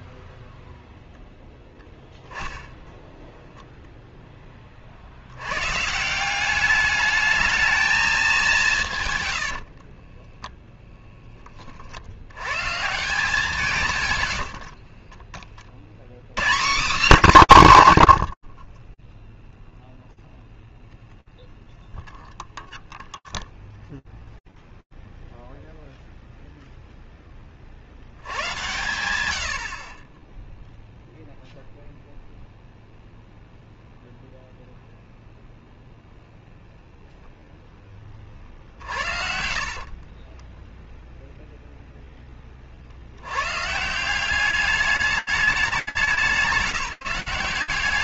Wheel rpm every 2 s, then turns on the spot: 0, 10, 10, 190, 180, 10, 100, 80, 190, 40, 0, 0, 0, 10, 90, 0, 0, 0, 10, 60, 0, 140, 190, 180.
14-16 38-40